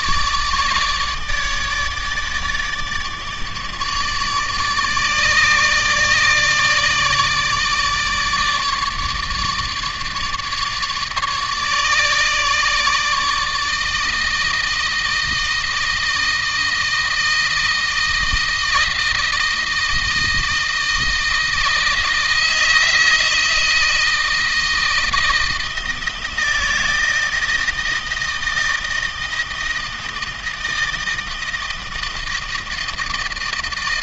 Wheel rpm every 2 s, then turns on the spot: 150, 150, 150, 150, 150, 150, 150, 160, 160, 160, 160, 160, 160, 160, 160, 160, 160.
none